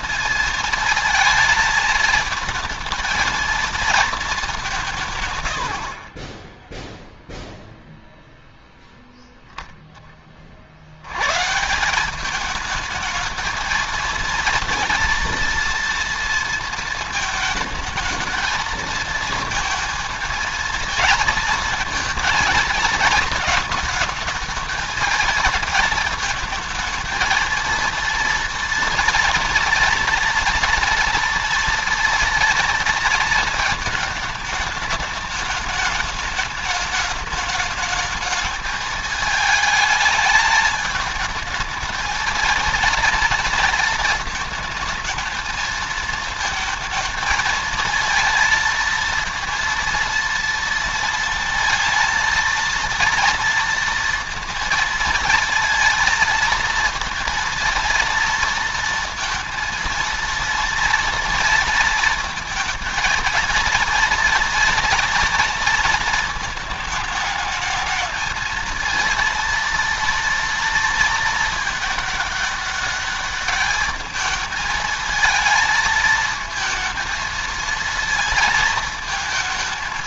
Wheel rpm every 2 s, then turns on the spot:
230, 220, 170, 0, 0, 80, 220, 230, 220, 220, 230, 220, 220, 230, 230, 230, 230, 210, 210, 220, 220, 230, 220, 220, 230, 230, 230, 230, 230, 230, 230, 230, 230, 220, 230, 230, 210, 220, 220, 220.
none